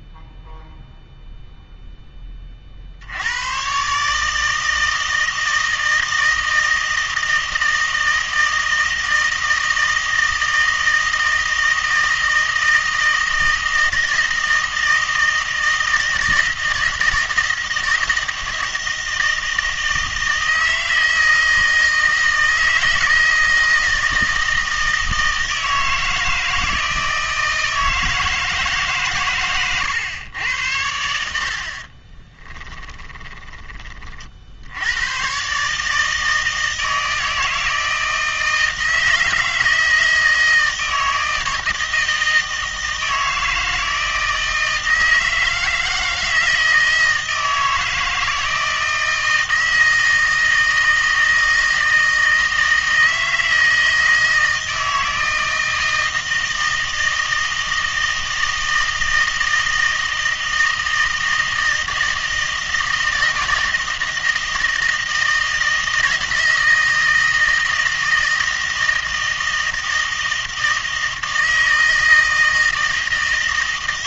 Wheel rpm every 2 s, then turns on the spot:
0, 60, 160, 160, 160, 160, 160, 160, 160, 160, 160, 160, 160, 160, 150, 80, 10, 80, 160, 160, 160, 160, 160, 160, 160, 160, 160, 160, 160, 160, 160, 160, 160, 160, 160, 160, 160.
32-34